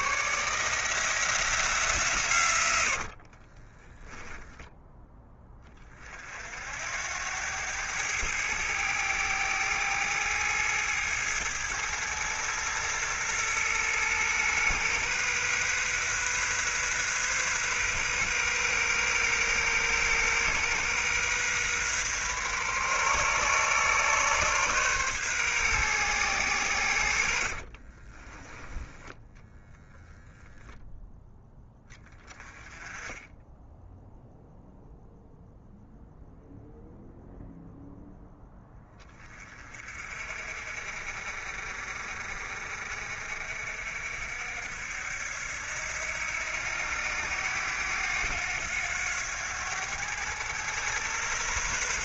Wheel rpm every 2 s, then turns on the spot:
160, 70, 10, 80, 110, 110, 120, 120, 130, 130, 130, 130, 130, 90, 10, 0, 10, 0, 0, 20, 50, 50, 70, 90, 90, 120.
2-4 26-28 32-34